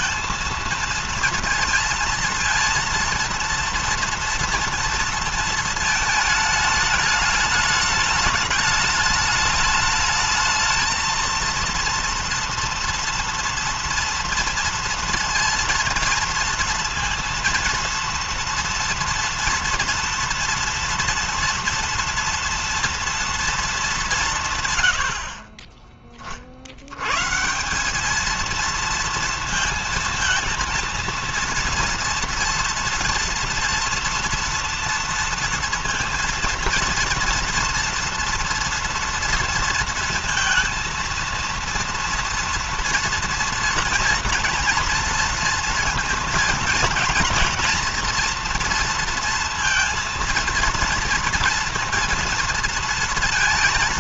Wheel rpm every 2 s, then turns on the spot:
230, 230, 230, 210, 210, 220, 230, 230, 230, 230, 230, 230, 90, 90, 230, 230, 230, 240, 230, 230, 230, 230, 230, 230, 230, 230, 210.
none